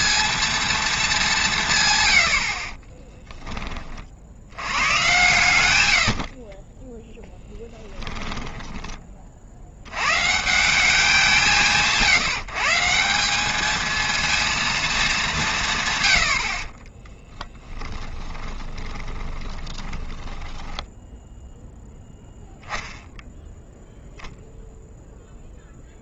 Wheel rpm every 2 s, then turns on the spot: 10, 110, 10, 20, 180, 160, 230, 30, 20, 10, 0, 0, 0.
0-2 14-20